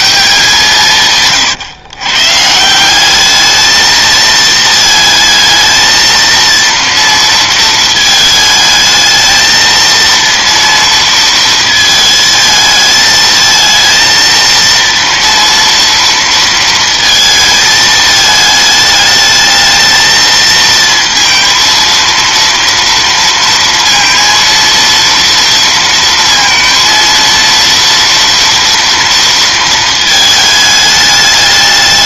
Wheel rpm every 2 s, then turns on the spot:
160, 180, 220, 230, 220, 230, 220, 230, 230, 210, 230, 230, 230, 230, 230, 210.
none